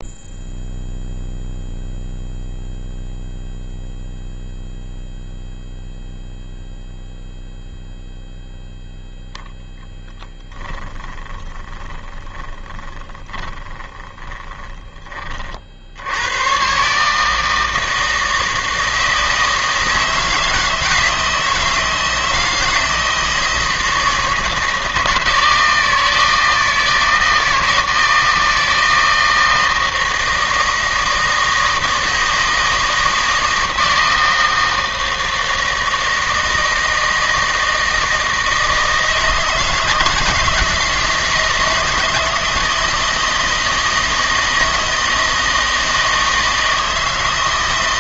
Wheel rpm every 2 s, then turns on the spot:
0, 0, 0, 0, 0, 10, 20, 20, 130, 160, 160, 160, 160, 160, 160, 160, 160, 160, 160, 160, 160, 160, 160, 160.
10-16